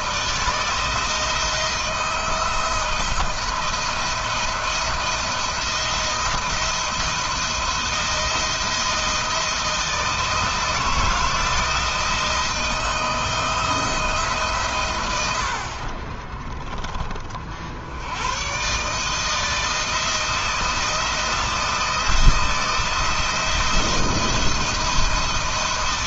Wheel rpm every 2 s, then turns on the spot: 170, 170, 170, 170, 160, 160, 160, 100, 30, 150, 170, 160, 170.
none